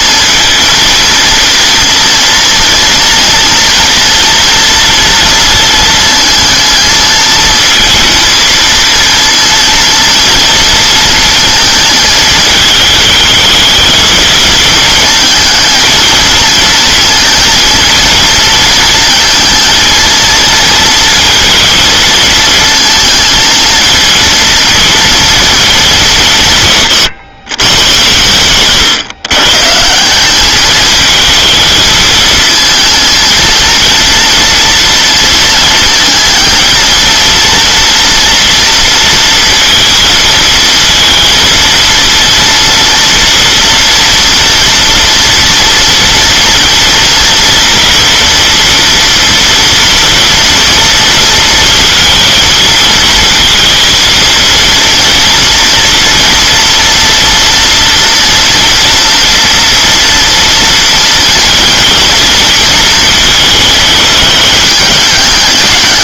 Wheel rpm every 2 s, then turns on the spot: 230, 230, 230, 220, 230, 230, 220, 220, 230, 230, 230, 230, 230, 160, 120, 200, 230, 230, 220, 230, 230, 230, 230, 240, 230, 230, 220, 230, 230, 230, 230, 230, 220.
28-30